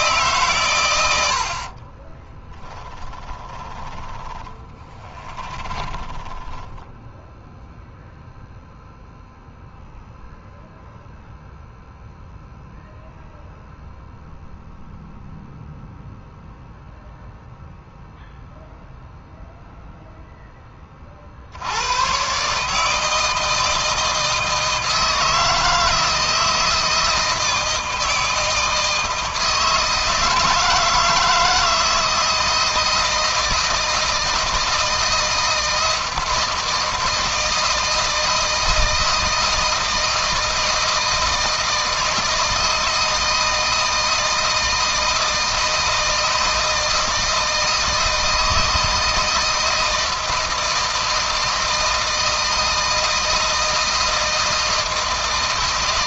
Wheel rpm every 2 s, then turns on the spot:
120, 10, 20, 10, 0, 0, 0, 0, 0, 0, 20, 150, 160, 160, 160, 160, 160, 160, 160, 160, 160, 160, 160, 160, 160, 160, 160, 160.
2-8